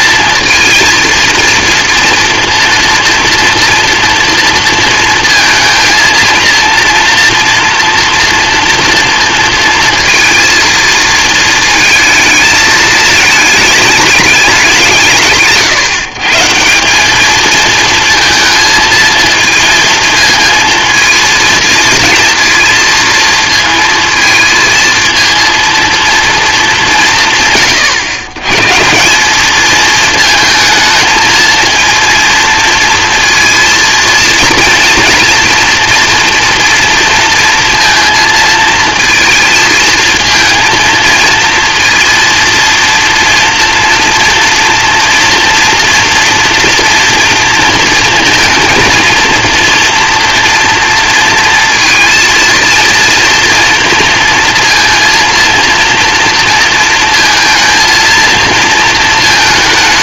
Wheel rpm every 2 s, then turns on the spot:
230, 230, 240, 230, 230, 230, 220, 190, 160, 230, 230, 230, 230, 220, 140, 220, 230, 230, 230, 230, 230, 230, 230, 230, 230, 230, 230, 230, 230, 230.
none